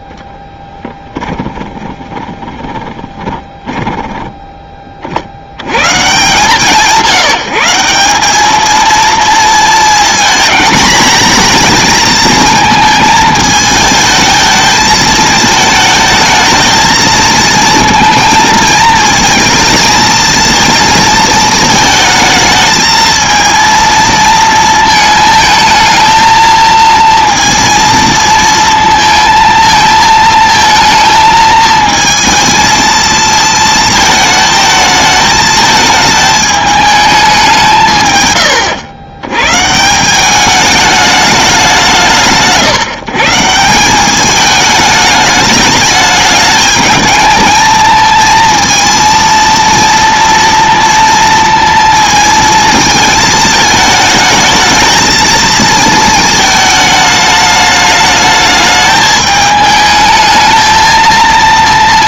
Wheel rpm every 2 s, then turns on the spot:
20, 20, 10, 150, 220, 220, 220, 220, 220, 220, 230, 220, 220, 230, 230, 220, 220, 220, 210, 110, 210, 160, 210, 210, 230, 230, 220, 220, 210, 210, 220.
0-4